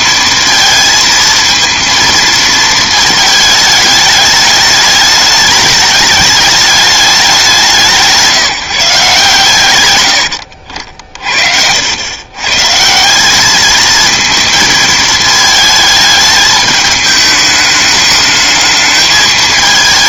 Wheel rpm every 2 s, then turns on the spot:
220, 230, 210, 210, 160, 60, 140, 220, 220, 210.
none